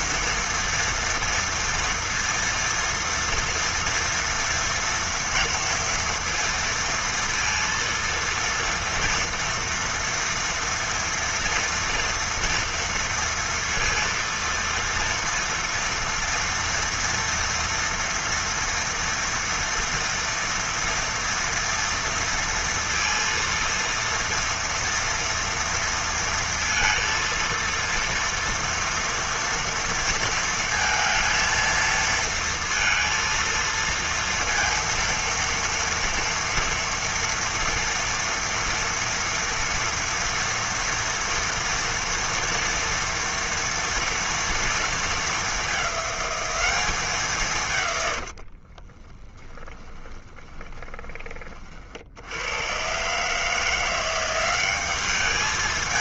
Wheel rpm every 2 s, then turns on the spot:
230, 230, 230, 230, 230, 240, 230, 230, 230, 230, 230, 230, 230, 230, 230, 230, 230, 230, 230, 230, 230, 230, 230, 200, 50, 20, 100, 190.
48-52